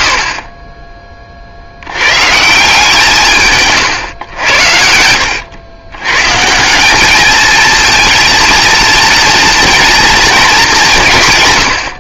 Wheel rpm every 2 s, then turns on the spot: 40, 150, 90, 170, 230, 210.
4-6